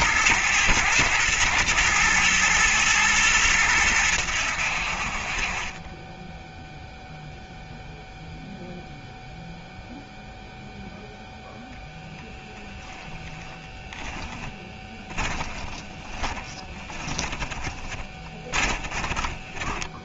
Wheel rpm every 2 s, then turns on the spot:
110, 110, 60, 0, 0, 0, 10, 10, 10, 30.
12-20